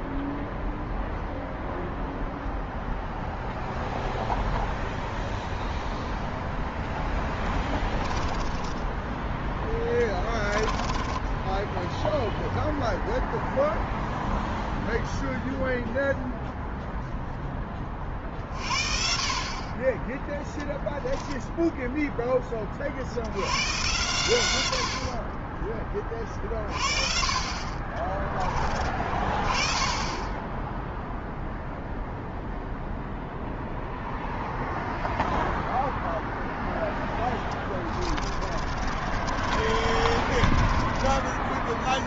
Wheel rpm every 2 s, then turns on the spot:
0, 0, 0, 10, 10, 10, 0, 0, 0, 40, 10, 80, 30, 40, 20, 0, 0, 0, 10, 40, 20.
6-8 10-12 36-42